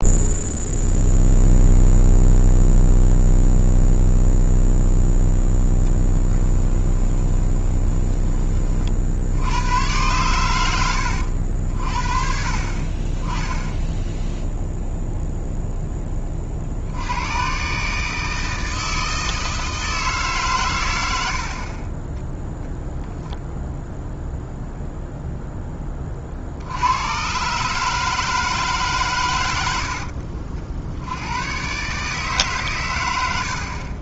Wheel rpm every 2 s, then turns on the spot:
0, 0, 0, 10, 40, 90, 30, 0, 60, 160, 120, 0, 0, 80, 140, 70, 120.
6-8